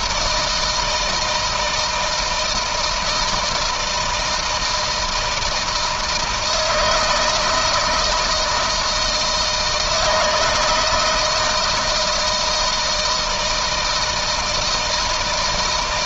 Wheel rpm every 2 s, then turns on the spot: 160, 160, 160, 160, 170, 160, 160, 160.
none